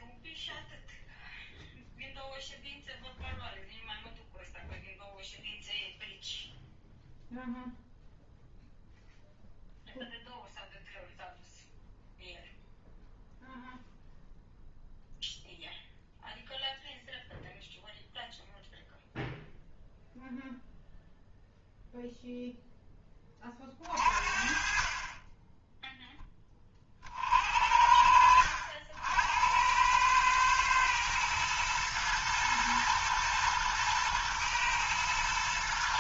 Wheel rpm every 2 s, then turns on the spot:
0, 0, 0, 0, 0, 0, 0, 0, 0, 0, 0, 0, 40, 30, 70, 110, 110, 110.
none